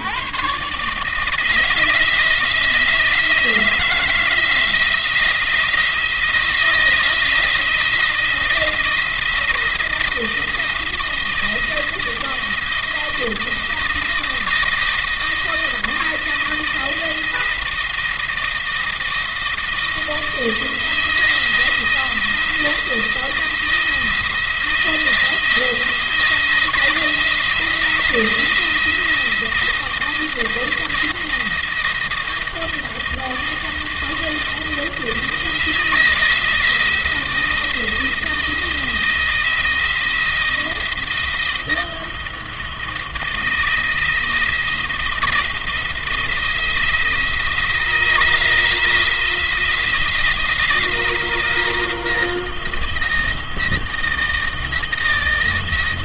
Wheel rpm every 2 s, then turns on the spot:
150, 170, 170, 160, 170, 170, 170, 170, 170, 160, 170, 170, 160, 160, 170, 170, 160, 160, 160, 160, 170, 160, 170, 160, 160, 170, 170, 160.
none